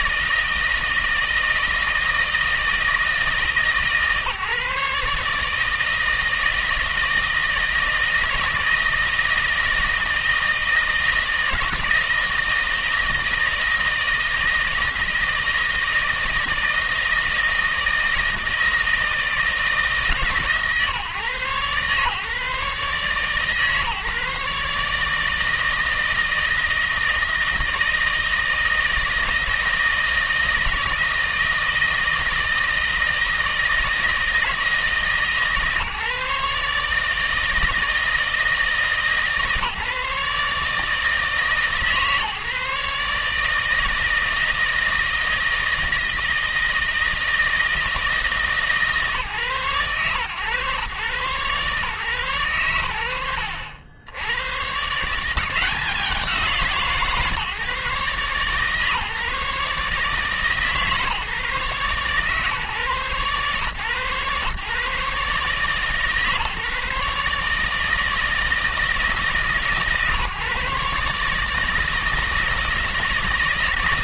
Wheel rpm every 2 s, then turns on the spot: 160, 160, 150, 160, 160, 160, 160, 160, 160, 160, 130, 150, 150, 160, 160, 160, 160, 150, 150, 150, 150, 150, 160, 160, 140, 130, 100, 130, 160, 130, 150, 140, 130, 150, 160, 140, 160.
none